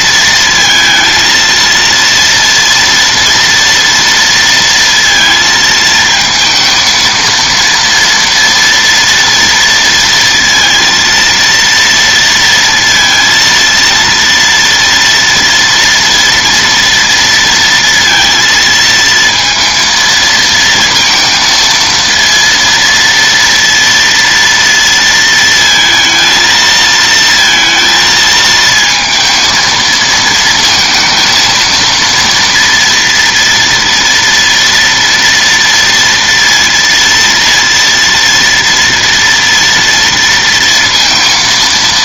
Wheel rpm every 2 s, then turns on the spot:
230, 230, 230, 230, 230, 230, 230, 230, 230, 230, 230, 230, 230, 230, 220, 230, 230, 230, 230, 240, 230.
none